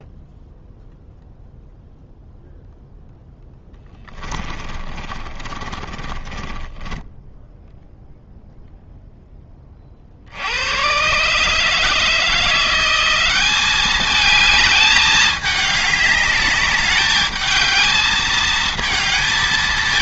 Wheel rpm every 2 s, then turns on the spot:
0, 0, 30, 20, 0, 100, 170, 210, 200, 220.
4-8